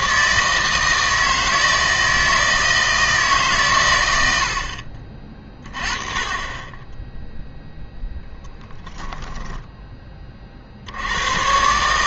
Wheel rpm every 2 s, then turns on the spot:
160, 160, 60, 10, 10, 60.
4-6 8-10